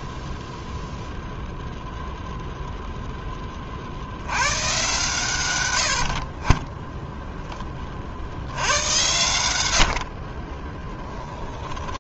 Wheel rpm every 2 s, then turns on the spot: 0, 0, 120, 20, 110, 20.
10-12